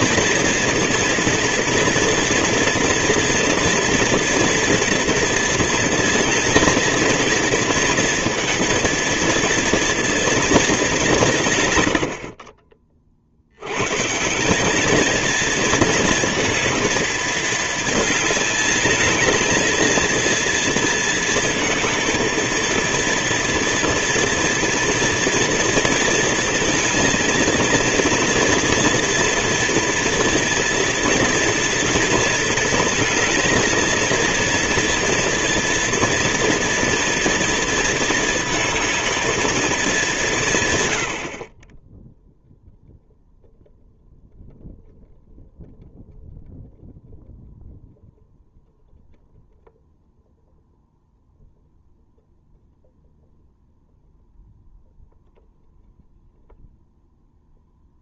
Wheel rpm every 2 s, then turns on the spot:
230, 230, 240, 230, 230, 220, 40, 200, 220, 220, 230, 230, 230, 230, 230, 230, 230, 230, 240, 220, 140, 0, 0, 0, 0, 0, 0, 0, 0.
none